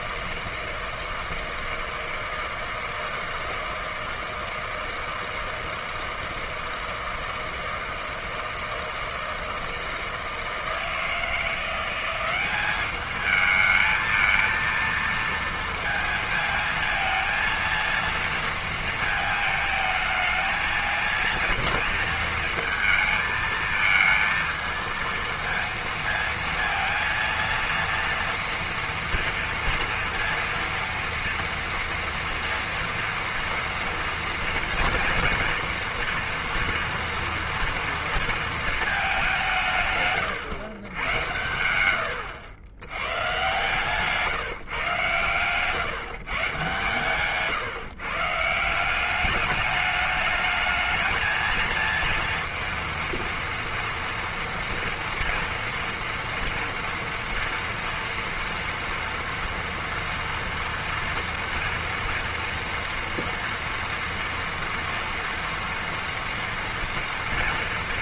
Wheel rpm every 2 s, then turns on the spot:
160, 160, 160, 160, 160, 160, 200, 230, 220, 230, 220, 230, 230, 230, 230, 230, 230, 230, 240, 220, 110, 110, 140, 140, 180, 220, 230, 230, 230, 230, 230, 230, 240, 230.
none